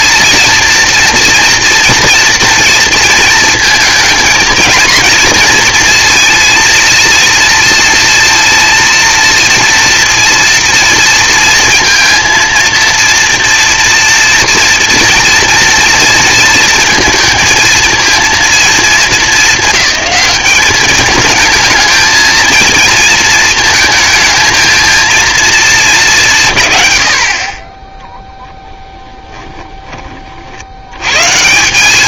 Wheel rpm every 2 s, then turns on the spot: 220, 230, 220, 230, 230, 240, 230, 230, 230, 230, 210, 230, 220, 150, 10, 70.
none